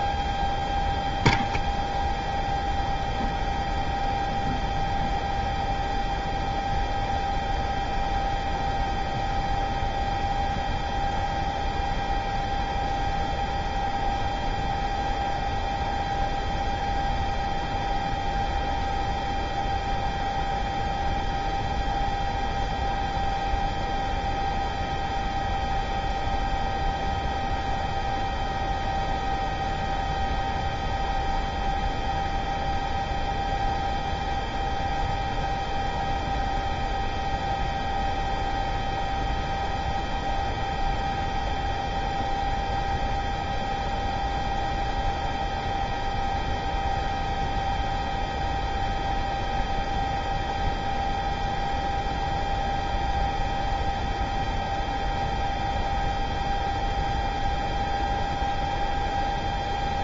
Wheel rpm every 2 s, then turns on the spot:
0, 0, 0, 0, 0, 0, 0, 0, 0, 0, 0, 0, 0, 0, 0, 0, 0, 0, 0, 0, 0, 0, 0, 0, 0, 0, 0, 0, 0, 0.
none